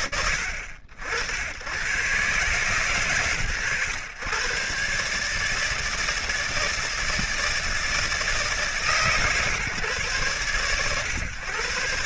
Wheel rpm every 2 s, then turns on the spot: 70, 120, 130, 160, 150, 120.
none